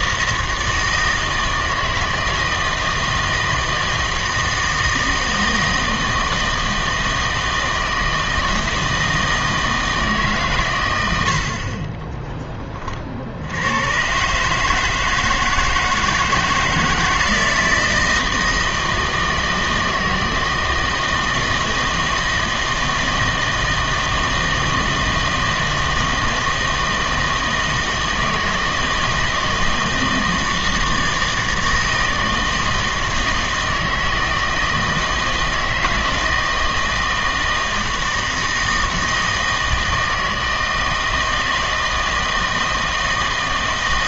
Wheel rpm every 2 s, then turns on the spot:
160, 160, 160, 160, 160, 120, 20, 150, 160, 160, 160, 160, 160, 160, 160, 160, 160, 160, 160, 160, 160, 160.
none